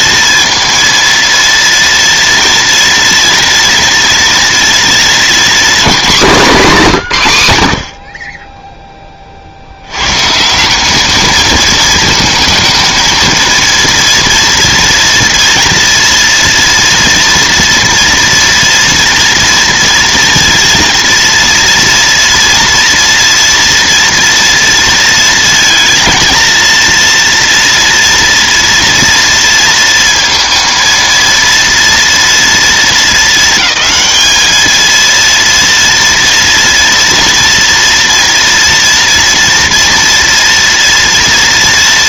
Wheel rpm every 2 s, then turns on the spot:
230, 230, 230, 210, 10, 170, 220, 230, 230, 230, 230, 230, 230, 230, 230, 230, 230, 220, 240, 230, 230.
none